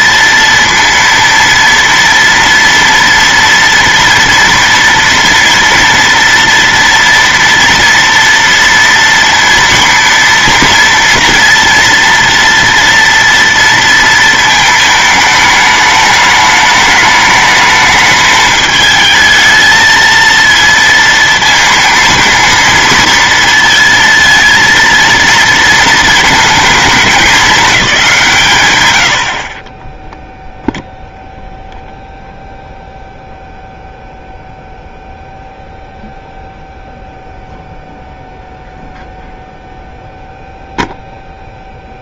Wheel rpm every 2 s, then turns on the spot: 230, 230, 240, 230, 230, 230, 230, 220, 210, 220, 230, 230, 230, 220, 120, 0, 0, 0, 0, 0, 0.
none